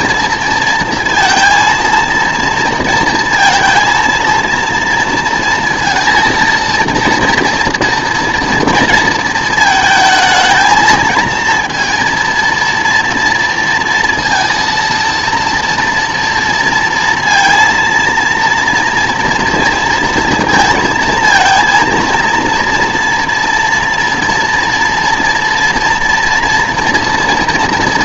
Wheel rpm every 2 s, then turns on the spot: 230, 230, 230, 230, 230, 230, 240, 230, 230, 230, 230, 230, 240, 230.
none